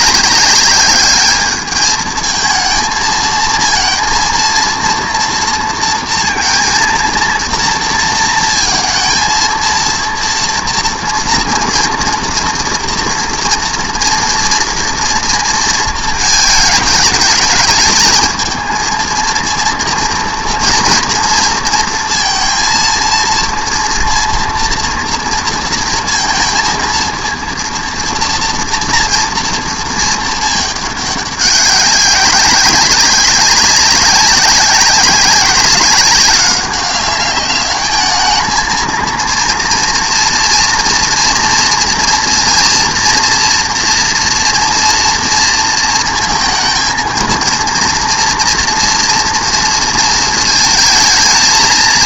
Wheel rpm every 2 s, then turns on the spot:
200, 220, 230, 230, 230, 230, 230, 230, 220, 220, 230, 230, 230, 230, 230, 220, 190, 190, 190, 220, 230, 230, 240, 230, 230, 220.
none